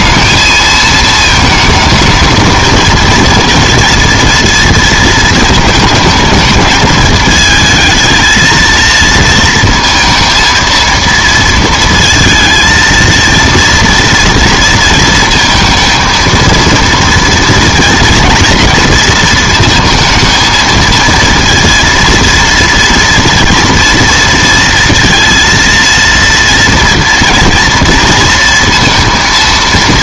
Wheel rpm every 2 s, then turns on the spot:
220, 230, 230, 210, 220, 230, 230, 220, 230, 230, 230, 230, 230, 230, 230.
none